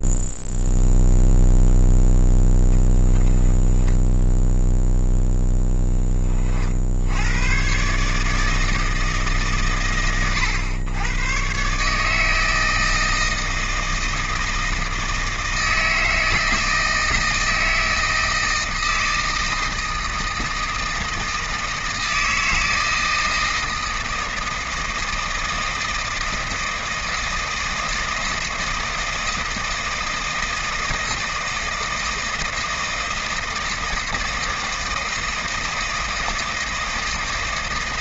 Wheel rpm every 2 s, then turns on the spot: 0, 10, 0, 70, 160, 110, 160, 160, 160, 160, 160, 160, 160, 160, 160, 160, 160, 160, 160.
none